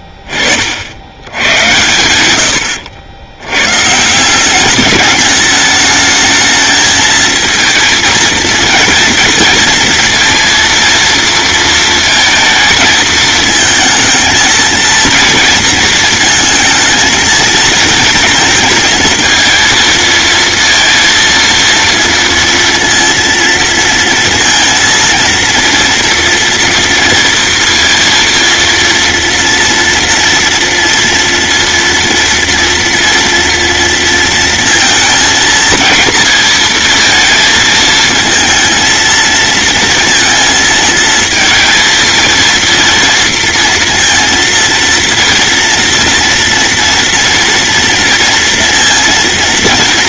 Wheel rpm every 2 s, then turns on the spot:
70, 80, 200, 220, 230, 230, 220, 230, 220, 220, 230, 230, 230, 240, 230, 230, 240, 230, 220, 230, 220, 230, 230, 230, 230.
none